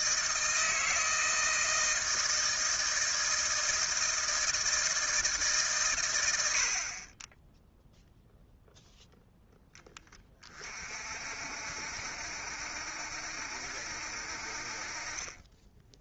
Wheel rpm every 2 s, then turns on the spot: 160, 160, 160, 80, 0, 30, 70, 50.
none